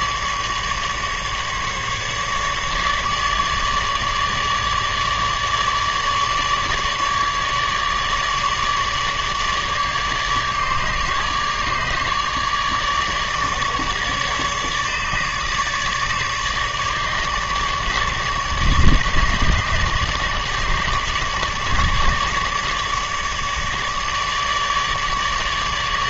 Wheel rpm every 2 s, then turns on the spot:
150, 150, 150, 150, 150, 150, 150, 150, 150, 150, 150, 150, 150.
none